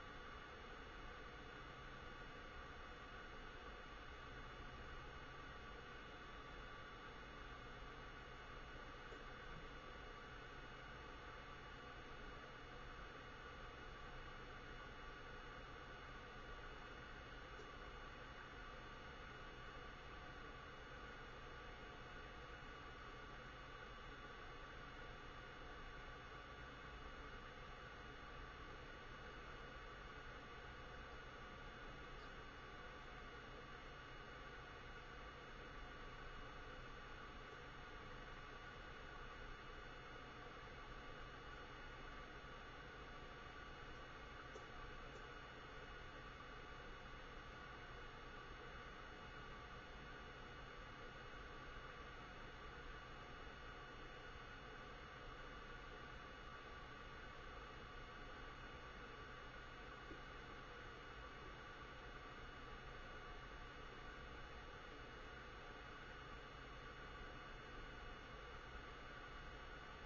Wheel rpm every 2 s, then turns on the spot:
0, 0, 0, 0, 0, 0, 0, 0, 0, 0, 0, 0, 0, 0, 0, 0, 0, 0, 0, 0, 0, 0, 0, 0, 0, 0, 0, 0, 0, 0, 0, 0, 0, 0, 0.
none